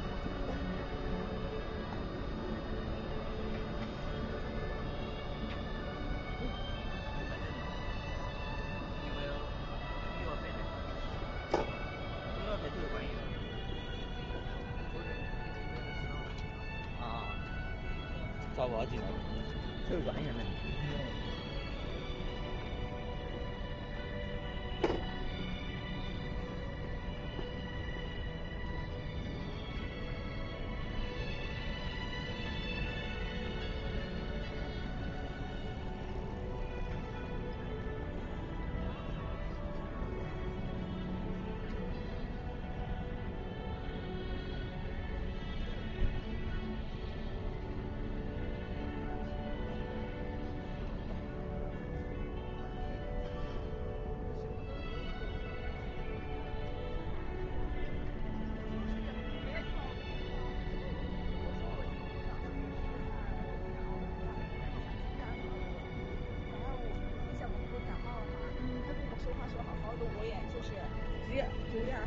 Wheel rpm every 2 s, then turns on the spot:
0, 0, 0, 0, 0, 0, 0, 0, 0, 0, 0, 0, 0, 0, 0, 0, 0, 0, 0, 0, 0, 0, 0, 0, 0, 0, 0, 0, 0, 0, 0, 0, 0, 0, 0, 0.
none